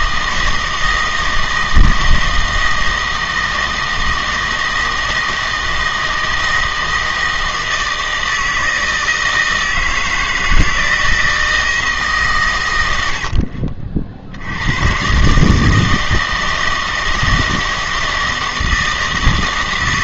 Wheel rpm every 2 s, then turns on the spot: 160, 160, 160, 160, 160, 160, 100, 90, 160, 160.
none